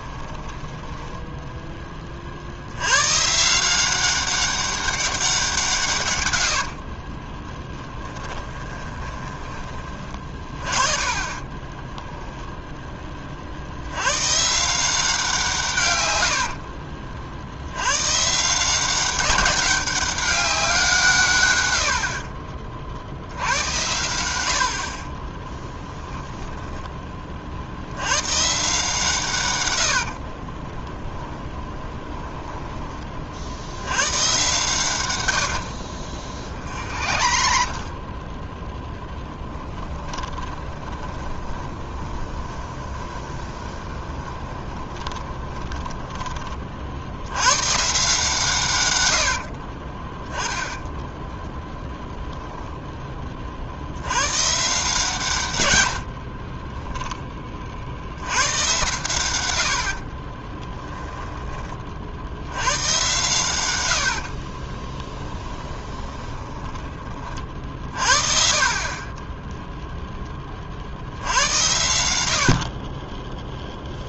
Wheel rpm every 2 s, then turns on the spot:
10, 70, 200, 80, 20, 30, 10, 160, 50, 170, 190, 40, 70, 10, 140, 20, 10, 120, 50, 10, 20, 20, 20, 30, 130, 10, 0, 140, 30, 110, 10, 100, 20, 20, 40, 50, 40.
0-2 6-10 16-18 30-32 36-38 40-46 56-58 60-62 64-68